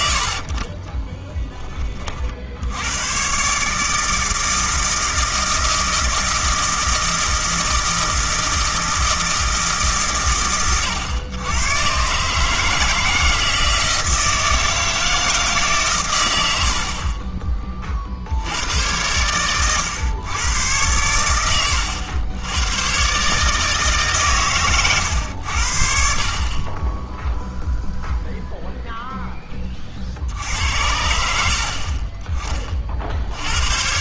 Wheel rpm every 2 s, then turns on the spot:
20, 90, 160, 160, 160, 120, 160, 160, 70, 90, 100, 110, 120, 20, 0, 80, 30.
0-2